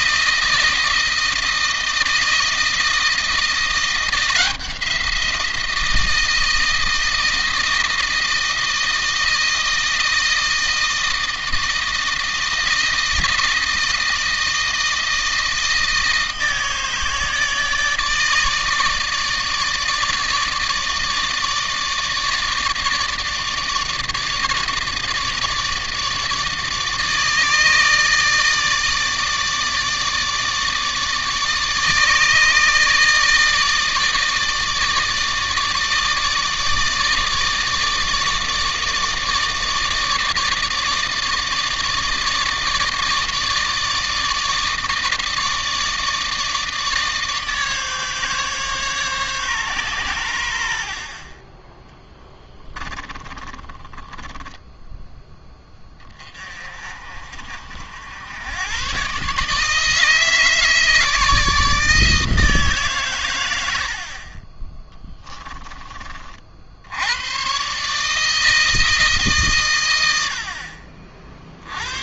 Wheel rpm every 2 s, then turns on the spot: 160, 160, 170, 160, 160, 160, 160, 160, 160, 160, 160, 160, 160, 150, 150, 150, 150, 150, 160, 160, 150, 150, 150, 150, 140, 80, 10, 10, 30, 100, 160, 140, 20, 50, 160, 60.
52-54